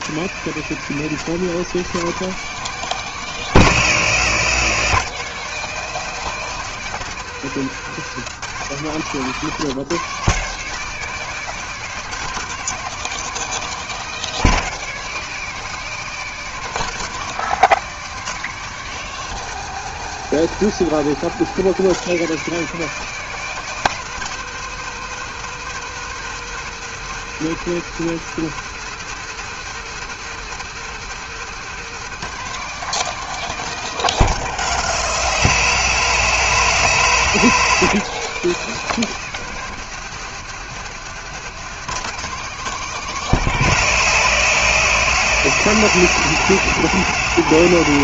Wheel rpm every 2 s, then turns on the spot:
160, 160, 150, 170, 140, 180, 180, 180, 170, 170, 160, 180, 170, 170, 160, 160, 180, 150, 150, 170, 160, 170, 140, 150.
none